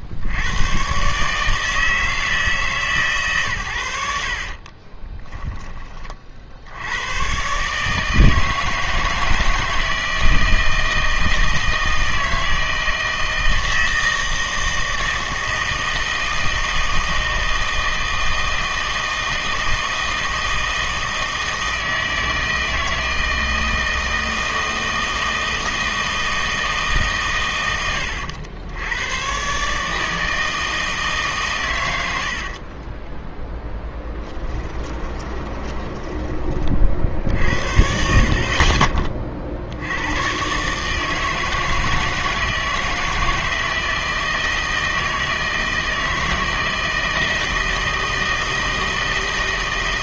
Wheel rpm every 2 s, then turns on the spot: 90, 150, 30, 80, 160, 160, 160, 160, 160, 160, 160, 160, 160, 160, 90, 160, 50, 20, 30, 40, 140, 160, 160, 160, 160.
4-6 32-36